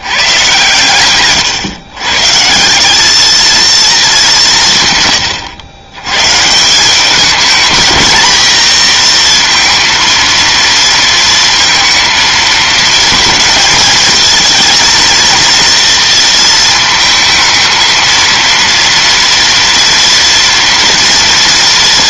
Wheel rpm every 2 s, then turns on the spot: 140, 170, 160, 170, 240, 230, 220, 230, 220, 230, 230.
none